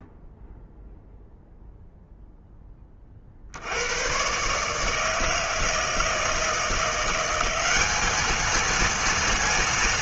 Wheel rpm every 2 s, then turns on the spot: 0, 10, 130, 160, 220.
none